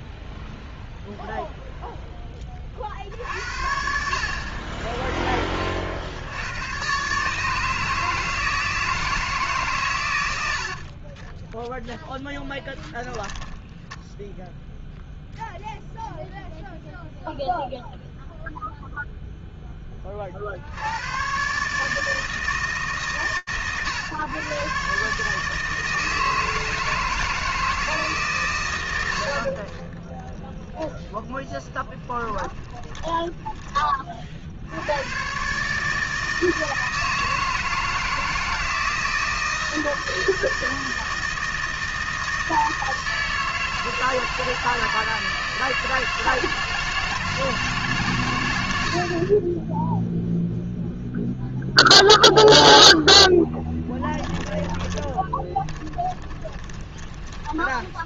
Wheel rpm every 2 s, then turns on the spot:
0, 20, 50, 80, 160, 90, 10, 0, 0, 0, 50, 160, 120, 160, 150, 20, 10, 90, 160, 160, 160, 160, 160, 160, 70, 0, 0, 20, 20.
12-14 30-34 54-58